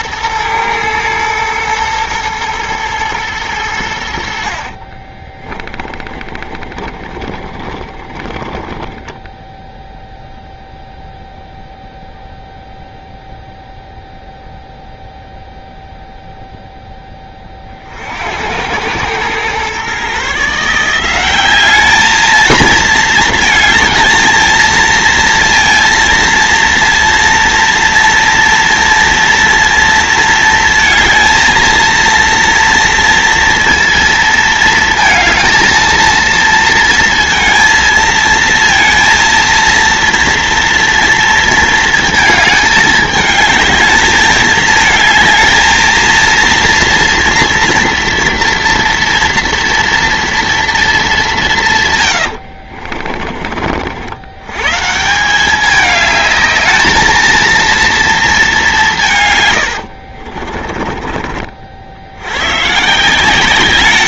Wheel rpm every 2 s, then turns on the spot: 110, 110, 60, 30, 10, 0, 0, 0, 0, 90, 150, 220, 220, 230, 230, 230, 230, 230, 230, 220, 230, 220, 220, 230, 240, 230, 70, 120, 220, 210, 40, 120.
4-10 52-54 60-62